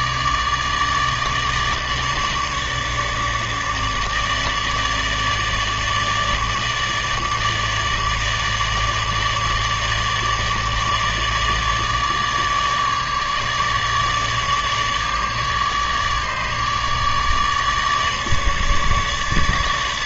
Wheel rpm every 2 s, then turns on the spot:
150, 150, 150, 150, 150, 150, 150, 150, 150, 150.
none